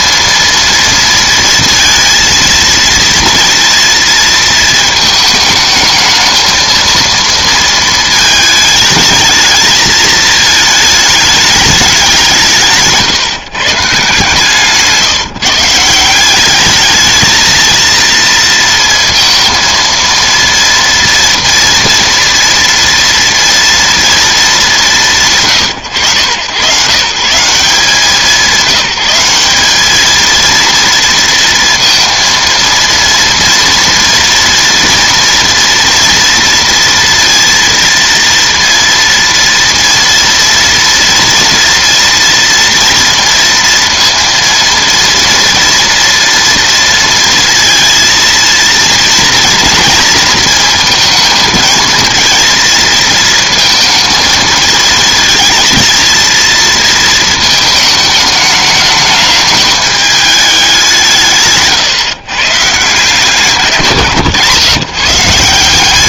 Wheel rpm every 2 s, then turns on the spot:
230, 230, 230, 230, 220, 220, 160, 170, 200, 230, 230, 230, 200, 110, 190, 230, 230, 230, 230, 230, 230, 230, 230, 230, 230, 230, 230, 220, 230, 210, 200, 140, 130.
none